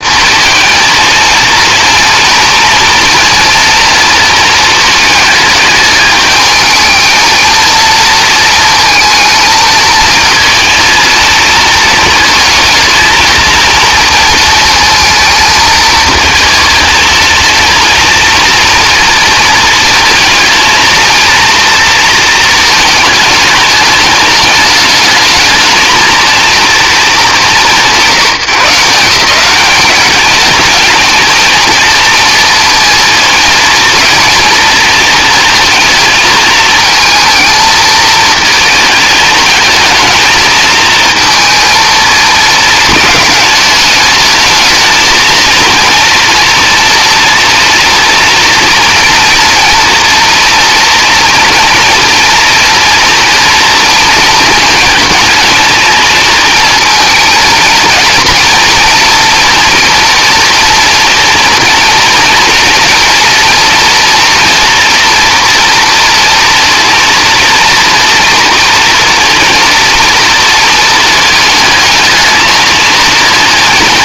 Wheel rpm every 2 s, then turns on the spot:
230, 230, 220, 220, 230, 230, 220, 220, 220, 230, 230, 220, 210, 220, 160, 220, 230, 230, 220, 220, 220, 220, 220, 230, 230, 240, 240, 230, 230, 230, 230, 230, 230, 230, 240, 220, 220.
none